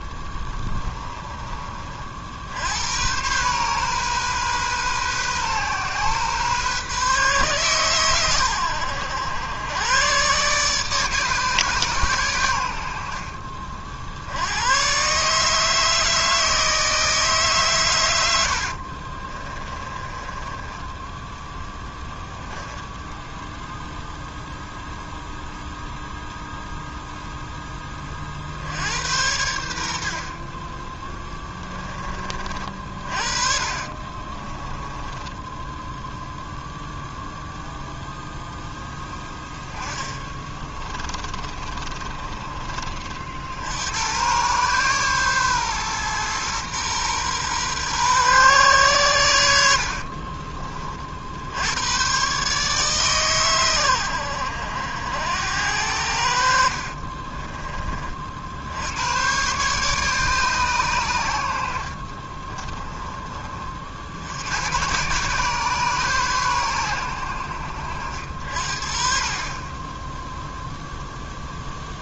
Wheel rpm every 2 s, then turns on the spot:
20, 70, 130, 130, 100, 140, 90, 90, 160, 80, 10, 10, 0, 0, 50, 40, 40, 30, 0, 0, 20, 20, 120, 120, 120, 30, 130, 80, 60, 70, 140, 30, 80, 110, 50, 0.
0-2 18-24 34-36 40-42 62-64